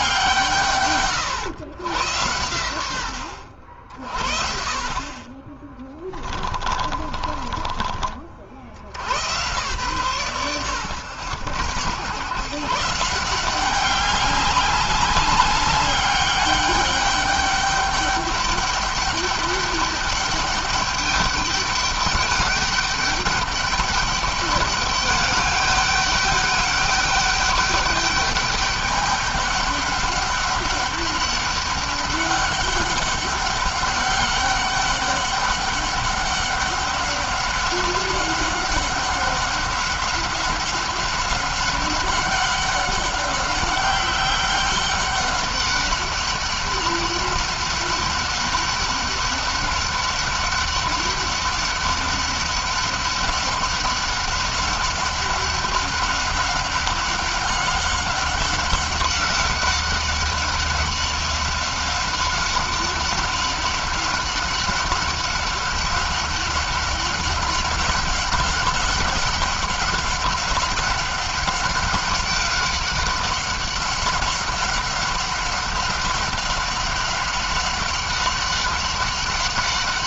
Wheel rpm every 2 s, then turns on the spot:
140, 100, 40, 30, 70, 80, 150, 200, 200, 200, 200, 200, 200, 200, 200, 200, 200, 200, 190, 190, 190, 190, 200, 190, 200, 190, 190, 190, 190, 190, 190, 190, 190, 190, 190, 190, 190, 190, 190, 190.
6-8